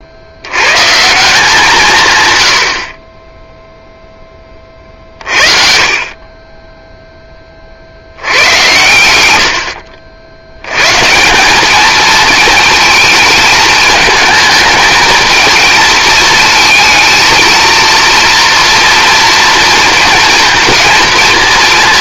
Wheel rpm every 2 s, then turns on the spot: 160, 50, 40, 10, 110, 110, 220, 220, 220, 230, 230.
none